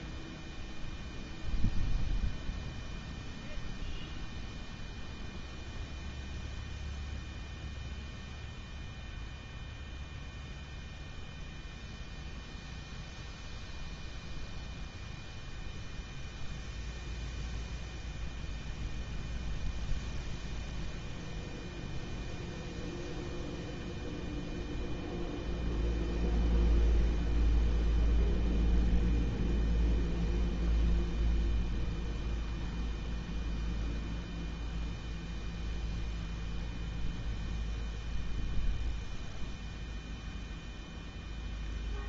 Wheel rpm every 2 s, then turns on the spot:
0, 0, 0, 0, 0, 0, 0, 0, 0, 0, 0, 0, 0, 0, 0, 0, 0, 0, 0, 0, 0.
none